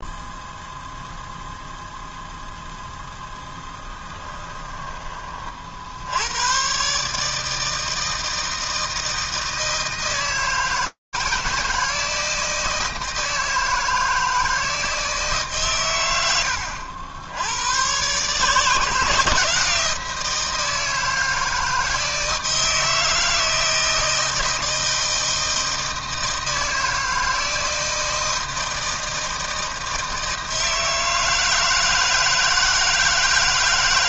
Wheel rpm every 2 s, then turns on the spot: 0, 0, 20, 140, 160, 160, 160, 160, 100, 160, 160, 160, 160, 160, 160, 160, 160.
none